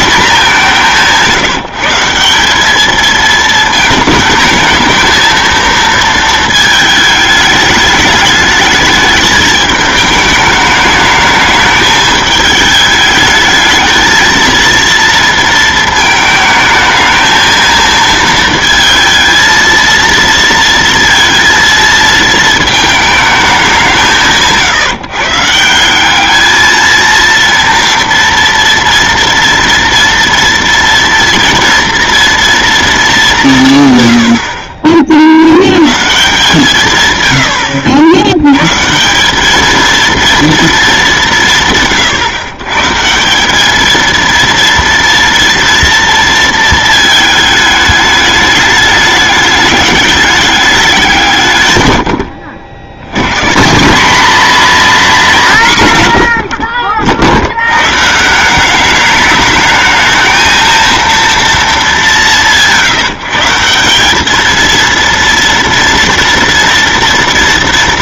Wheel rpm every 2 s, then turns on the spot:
190, 200, 220, 220, 210, 210, 210, 230, 220, 230, 230, 220, 150, 220, 230, 230, 230, 40, 150, 120, 220, 130, 230, 230, 210, 200, 70, 240, 70, 180, 220, 160, 220, 230.
none